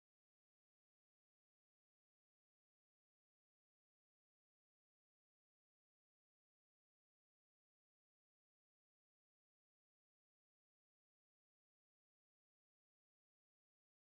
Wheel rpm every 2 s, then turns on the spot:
0, 0, 0, 0, 0, 0, 0.
none